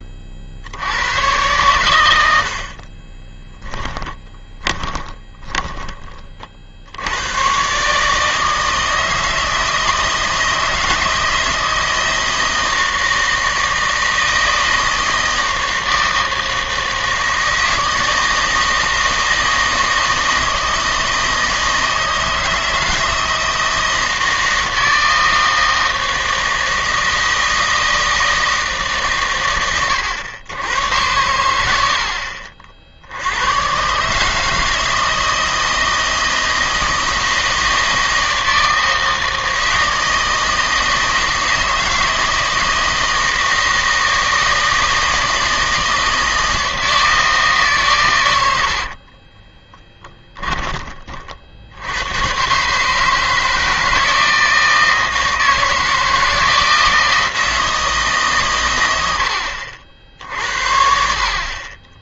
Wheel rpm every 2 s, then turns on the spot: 80, 40, 20, 50, 160, 160, 160, 160, 160, 160, 160, 160, 160, 160, 150, 100, 60, 160, 160, 160, 160, 160, 160, 160, 70, 20, 140, 160, 160, 110, 70.
2-6 48-50